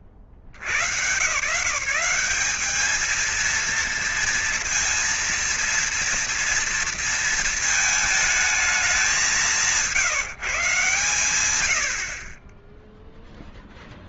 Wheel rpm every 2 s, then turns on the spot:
60, 190, 230, 230, 220, 160, 40.
12-14